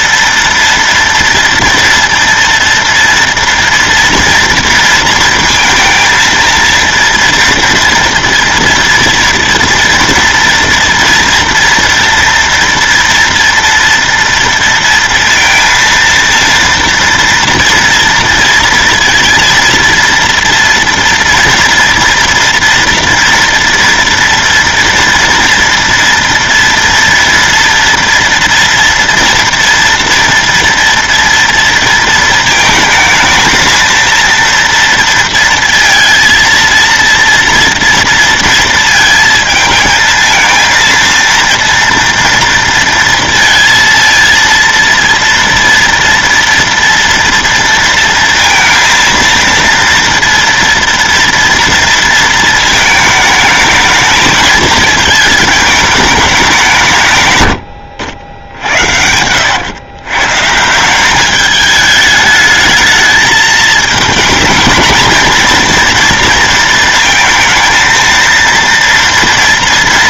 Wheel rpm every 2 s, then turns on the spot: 230, 230, 230, 230, 230, 230, 230, 230, 230, 230, 230, 230, 230, 230, 230, 230, 220, 230, 230, 220, 230, 230, 230, 230, 230, 230, 220, 220, 150, 80, 180, 220, 230, 220, 230.
58-60